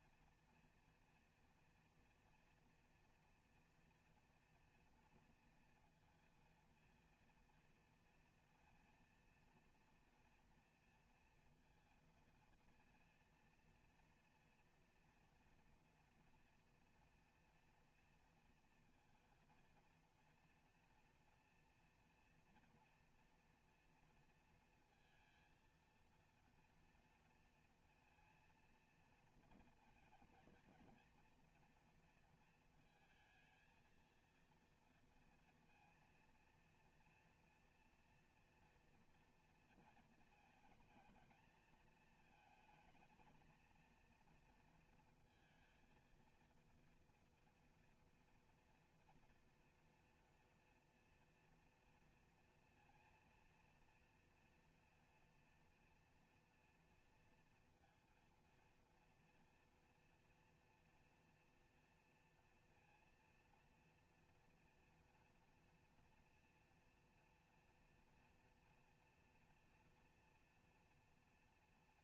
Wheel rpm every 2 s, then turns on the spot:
240, 230, 230, 230, 230, 230, 230, 230, 230, 230, 230, 240, 230, 230, 230, 230, 220, 230, 230, 230, 220, 230, 230, 230, 230, 230, 230, 240, 230, 240, 240, 230, 230, 230, 230, 230.
none